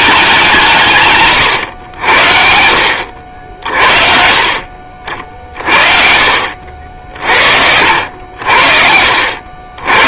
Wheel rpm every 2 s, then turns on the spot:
170, 70, 50, 60, 60.
6-8